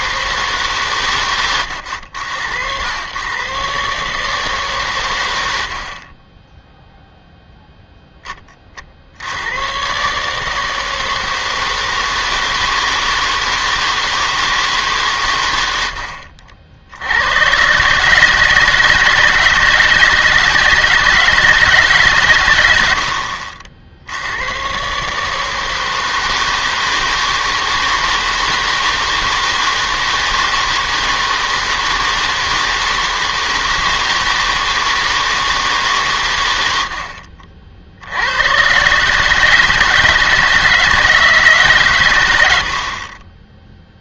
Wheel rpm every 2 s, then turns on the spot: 150, 90, 150, 10, 30, 160, 160, 150, 60, 150, 170, 100, 110, 160, 160, 160, 160, 160, 100, 110, 160, 80.
none